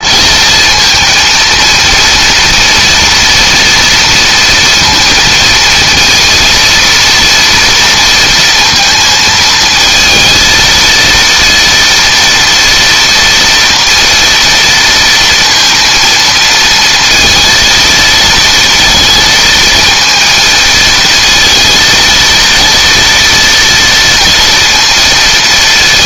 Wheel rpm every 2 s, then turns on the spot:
220, 230, 230, 230, 230, 230, 240, 230, 230, 230, 230, 230, 230.
none